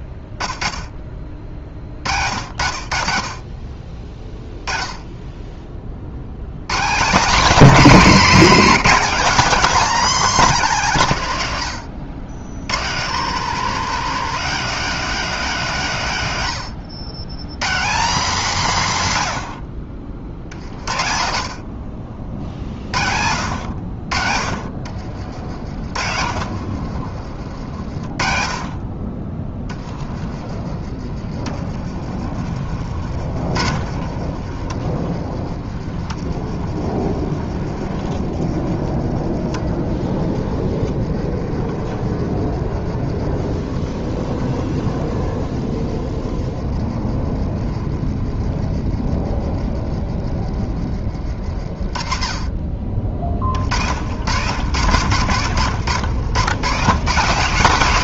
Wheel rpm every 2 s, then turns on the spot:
0, 70, 20, 140, 220, 210, 130, 230, 120, 210, 30, 50, 50, 60, 40, 40, 50, 40, 40, 40, 40, 40, 40, 40, 30, 30, 30, 110, 150.
24-28 32-34 36-38 40-50 54-56